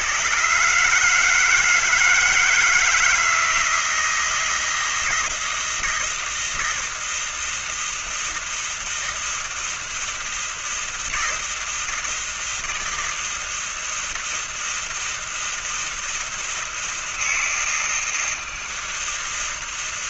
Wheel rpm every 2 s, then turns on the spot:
110, 160, 170, 160, 160, 160, 160, 160, 160, 160.
none